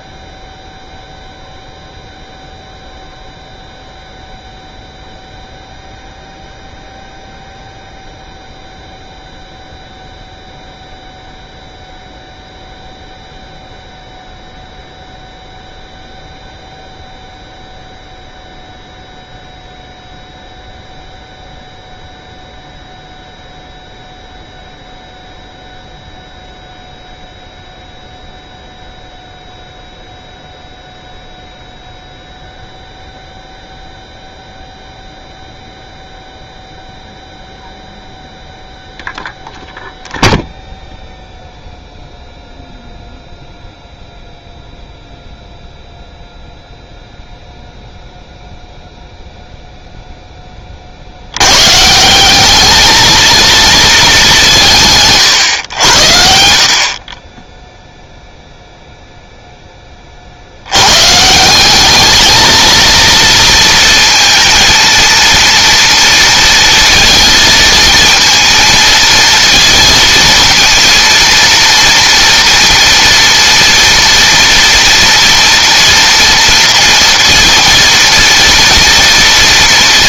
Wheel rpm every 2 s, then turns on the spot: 0, 0, 0, 0, 0, 0, 0, 0, 0, 0, 0, 0, 0, 0, 0, 0, 0, 0, 0, 0, 0, 0, 0, 0, 0, 30, 210, 170, 50, 0, 90, 230, 230, 230, 230, 230, 240, 230, 230, 240.
none